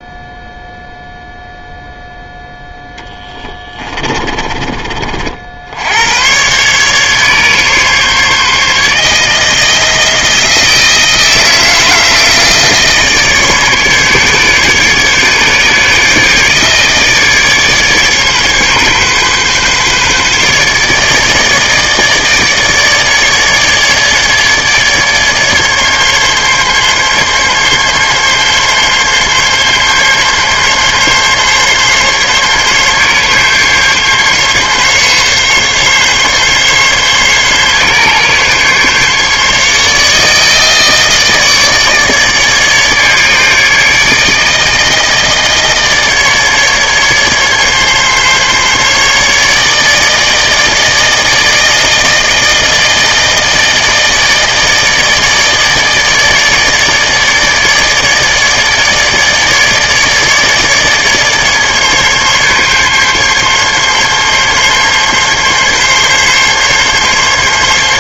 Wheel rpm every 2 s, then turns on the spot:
0, 0, 30, 130, 150, 160, 160, 140, 150, 140, 140, 150, 150, 140, 140, 140, 140, 140, 140, 140, 150, 150, 160, 150, 140, 160, 160, 160, 150, 150, 150, 140, 140, 140.
none